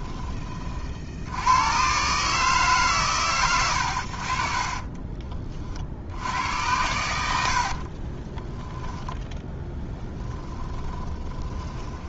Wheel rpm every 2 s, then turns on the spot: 60, 140, 30, 80, 10, 20.
4-6 8-12